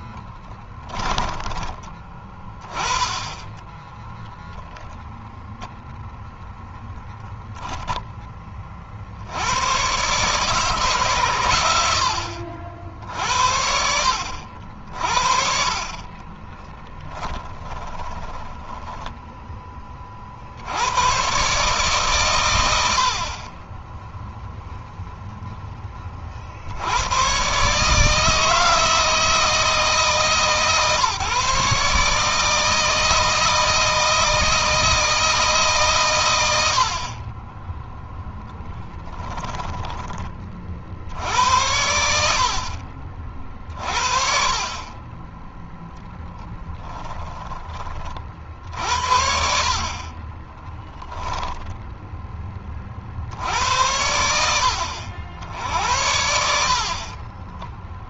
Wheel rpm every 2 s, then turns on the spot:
10, 20, 10, 0, 50, 140, 70, 60, 10, 10, 90, 70, 0, 70, 160, 140, 160, 160, 70, 10, 40, 60, 30, 20, 60, 10, 30, 70, 60.
0-2 16-20 38-40 46-48 50-52 56-58